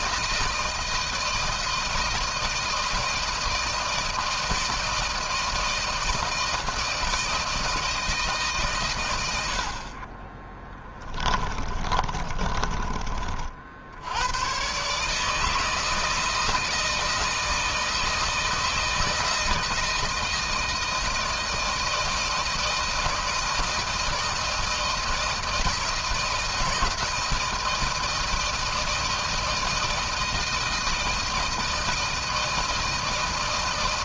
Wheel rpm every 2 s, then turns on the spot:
160, 160, 160, 160, 150, 30, 30, 100, 160, 160, 160, 160, 160, 160, 160, 160, 160.
10-14